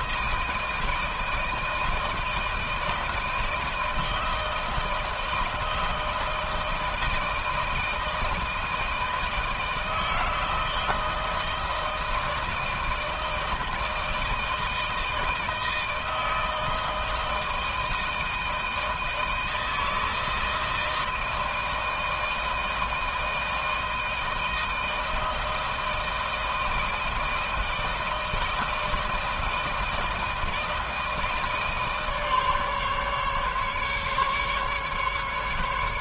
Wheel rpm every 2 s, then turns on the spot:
160, 160, 160, 160, 160, 160, 160, 160, 160, 160, 160, 160, 160, 160, 160, 160, 150, 150.
none